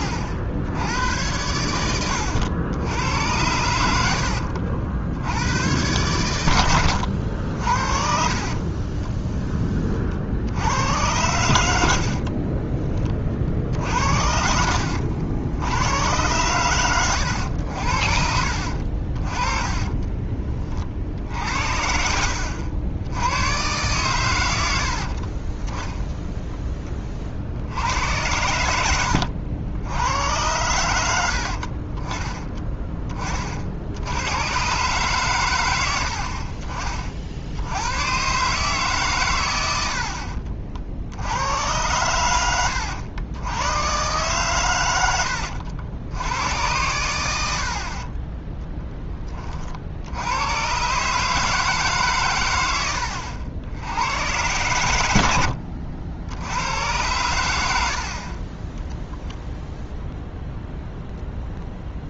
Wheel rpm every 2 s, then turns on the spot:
80, 90, 70, 100, 40, 90, 40, 60, 130, 50, 40, 70, 90, 10, 90, 90, 20, 120, 50, 140, 50, 100, 120, 100, 10, 120, 100, 100, 90, 20, 0.
4-6 12-14